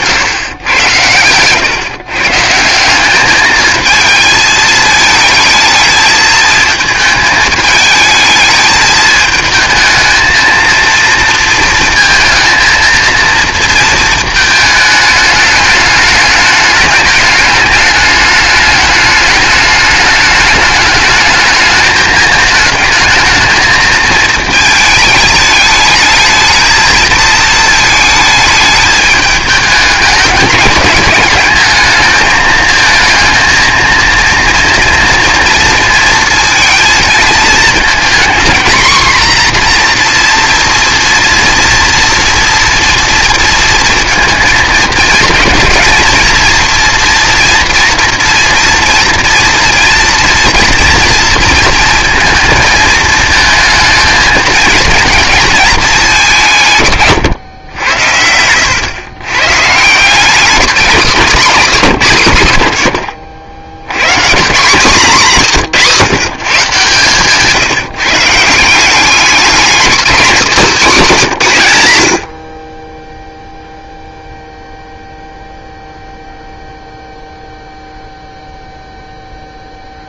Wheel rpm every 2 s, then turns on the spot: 120, 160, 220, 220, 220, 230, 230, 220, 210, 210, 210, 220, 220, 220, 210, 210, 220, 230, 230, 250, 230, 230, 230, 240, 240, 230, 220, 220, 160, 100, 200, 90, 170, 130, 170, 220, 40, 0, 0, 0.
70-72